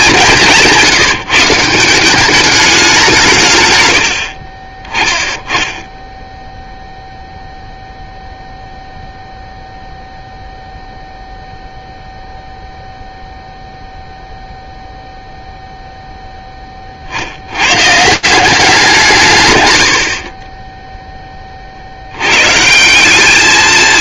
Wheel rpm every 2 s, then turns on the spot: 190, 200, 50, 0, 0, 0, 0, 0, 10, 180, 30, 130.
20-22